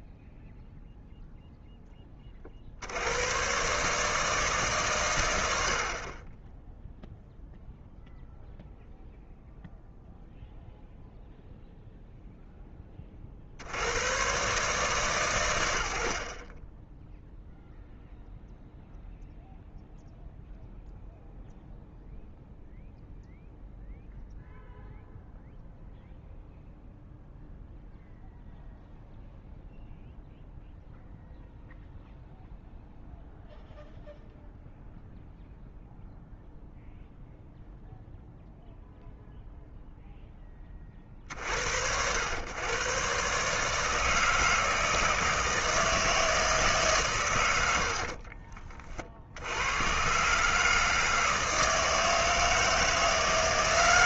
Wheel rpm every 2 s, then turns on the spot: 0, 50, 150, 10, 0, 0, 10, 140, 30, 0, 0, 0, 0, 0, 0, 0, 0, 0, 0, 0, 20, 110, 160, 150, 40, 150, 160.
none